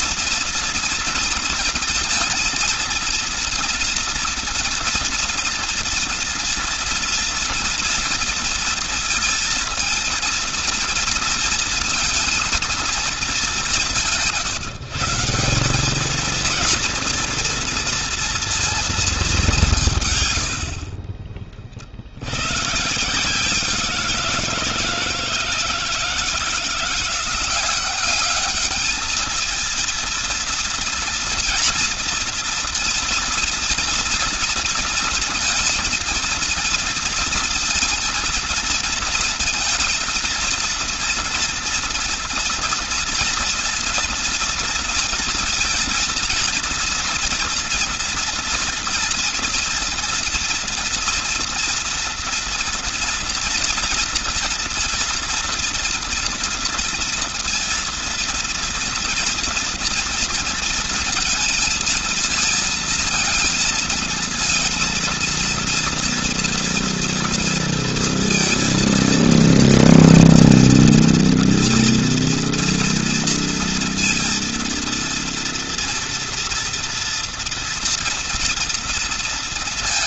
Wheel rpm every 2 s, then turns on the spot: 230, 230, 230, 230, 230, 220, 230, 170, 230, 230, 90, 110, 170, 170, 200, 230, 240, 230, 230, 230, 230, 230, 230, 230, 230, 240, 230, 230, 230, 230, 230, 230, 230, 230, 230, 230, 230, 230, 230, 230.
none